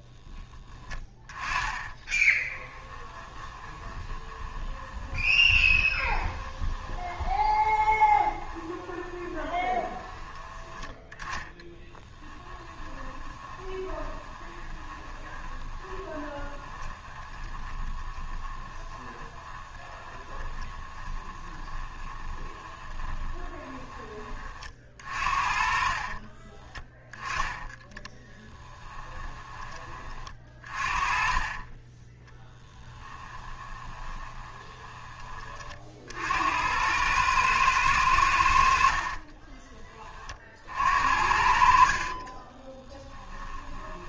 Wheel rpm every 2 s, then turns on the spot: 10, 10, 20, 20, 20, 10, 10, 20, 20, 20, 20, 20, 30, 20, 10, 30, 10, 20, 80, 80, 50, 30.
0-24 26-30 32-36 42-44